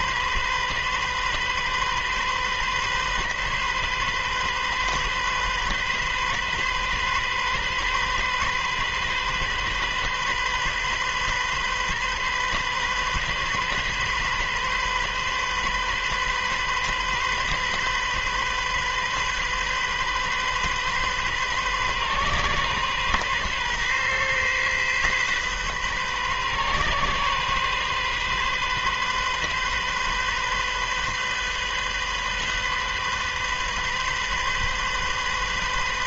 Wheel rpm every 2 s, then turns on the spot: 130, 130, 130, 130, 130, 130, 130, 130, 130, 130, 130, 130, 130, 130, 130, 130, 130, 130.
none